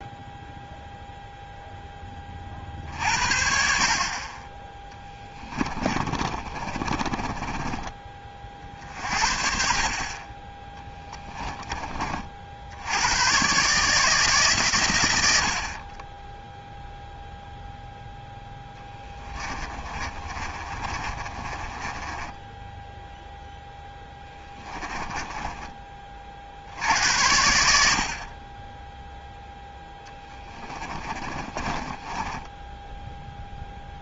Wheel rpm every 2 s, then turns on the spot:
0, 40, 10, 40, 40, 20, 50, 120, 0, 10, 30, 10, 10, 60, 30, 20, 10.
6-8 18-26 30-34